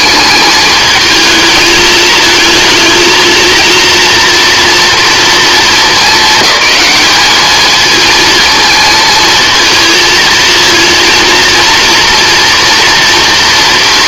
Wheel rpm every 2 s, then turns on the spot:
220, 220, 230, 210, 230, 230, 230.
none